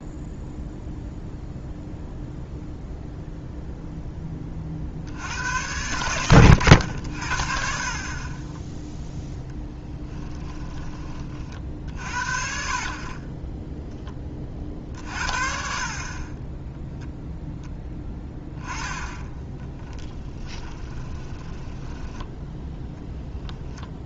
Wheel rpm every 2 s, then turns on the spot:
0, 0, 60, 90, 10, 30, 40, 50, 10, 10, 20, 0.
18-22